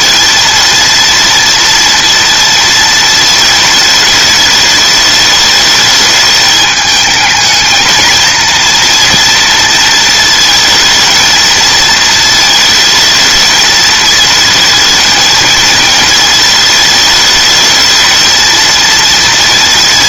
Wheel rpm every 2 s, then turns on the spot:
230, 230, 220, 210, 220, 230, 220, 220, 220, 220.
none